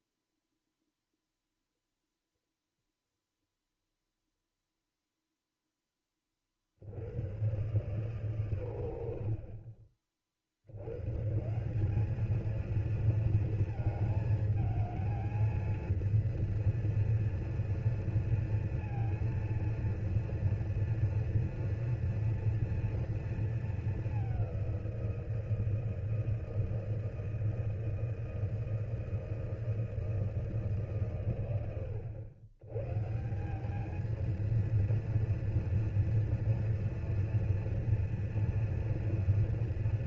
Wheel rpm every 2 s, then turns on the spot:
0, 0, 0, 50, 100, 80, 230, 220, 230, 230, 230, 230, 180, 160, 160, 150, 120, 230, 230, 230.
none